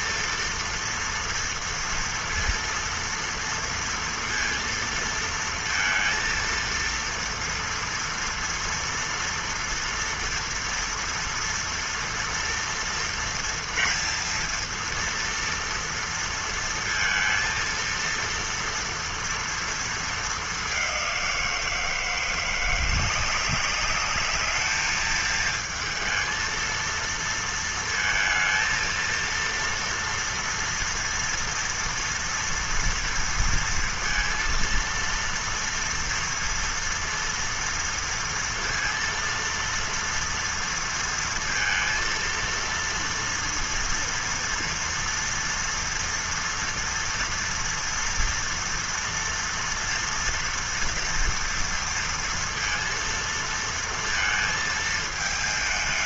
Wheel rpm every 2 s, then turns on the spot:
240, 230, 230, 230, 230, 230, 230, 230, 230, 230, 210, 170, 210, 230, 230, 230, 230, 230, 230, 230, 230, 230, 230, 230, 230, 240, 230, 230.
none